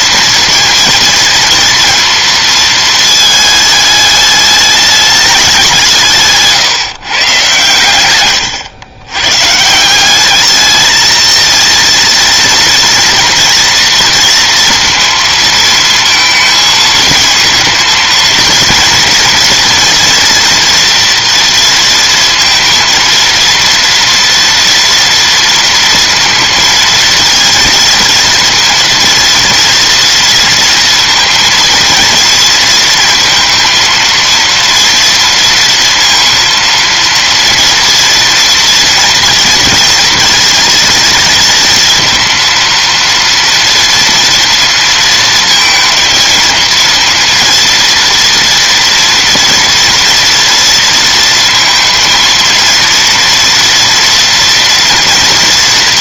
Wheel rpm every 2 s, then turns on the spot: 230, 230, 210, 150, 110, 210, 230, 230, 230, 230, 230, 230, 230, 230, 230, 230, 230, 230, 230, 230, 230, 230, 230, 230, 230, 230, 230, 230.
8-10